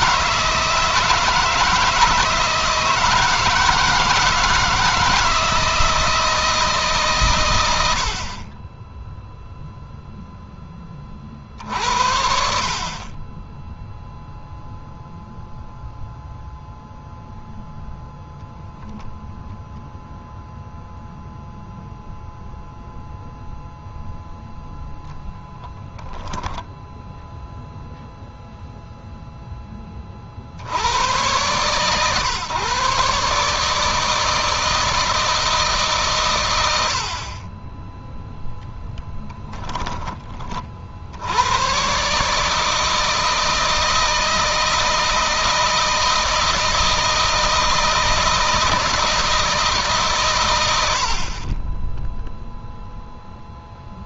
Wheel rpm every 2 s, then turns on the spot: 160, 160, 160, 150, 10, 20, 40, 0, 0, 0, 0, 0, 0, 10, 0, 80, 140, 160, 90, 0, 50, 160, 160, 170, 160, 90, 0.
none